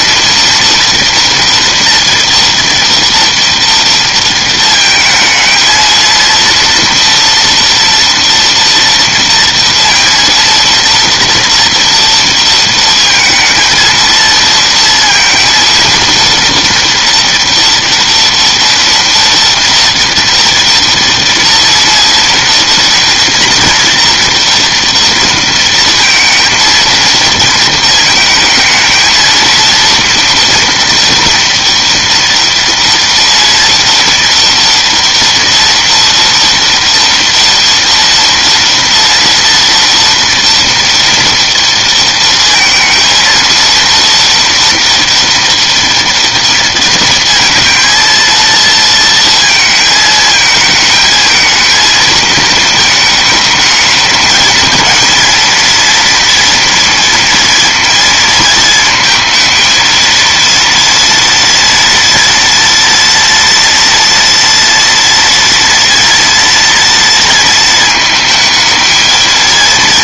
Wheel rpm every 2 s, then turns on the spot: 230, 230, 220, 230, 230, 230, 230, 230, 240, 240, 230, 230, 230, 230, 220, 230, 230, 230, 230, 230, 230, 230, 230, 230, 230, 220, 220, 220, 230, 230, 230, 230, 230, 230, 220.
none